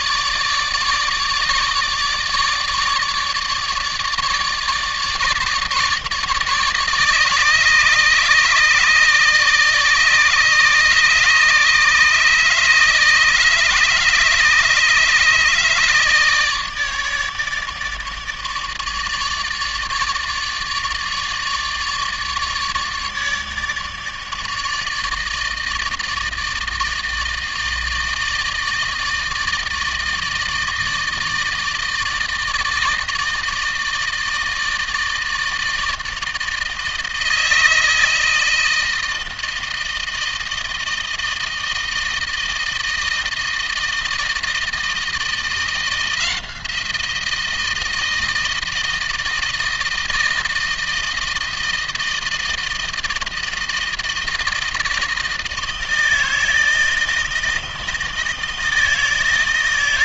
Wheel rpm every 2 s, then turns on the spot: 150, 150, 150, 150, 150, 150, 150, 150, 150, 150, 150, 150, 160, 160, 160, 160, 160, 160, 160, 160, 160, 160, 160, 170, 160, 160, 160, 160, 160, 160.
none